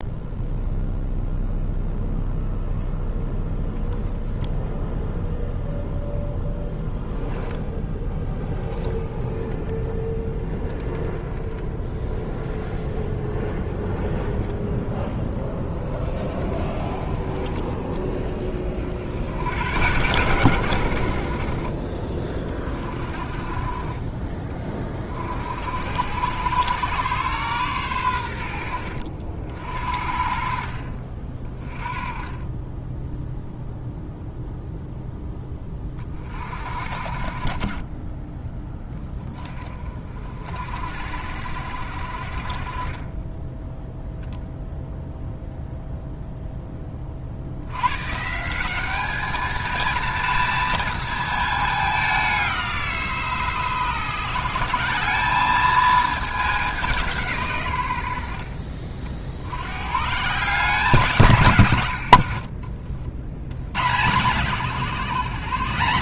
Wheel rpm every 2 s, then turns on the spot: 0, 0, 0, 0, 10, 10, 0, 0, 20, 70, 60, 30, 40, 120, 70, 40, 10, 10, 40, 30, 60, 20, 0, 50, 210, 220, 160, 200, 160, 60, 170, 70, 130.
none